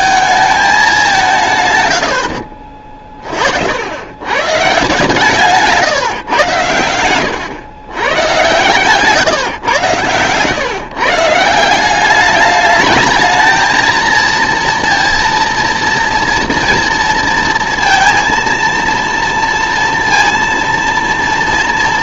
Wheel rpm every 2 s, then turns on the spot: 210, 50, 140, 100, 130, 130, 210, 230, 240, 230, 230.
none